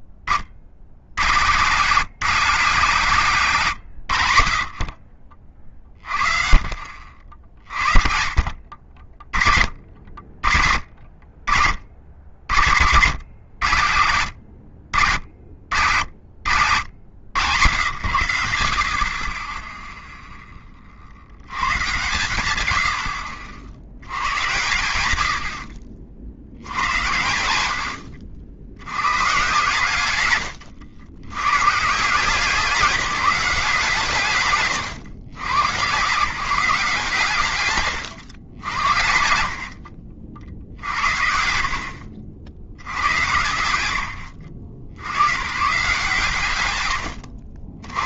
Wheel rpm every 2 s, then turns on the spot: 50, 170, 60, 40, 50, 60, 80, 80, 70, 70, 10, 110, 110, 90, 80, 110, 180, 120, 160, 100, 80, 80, 60, 130.
none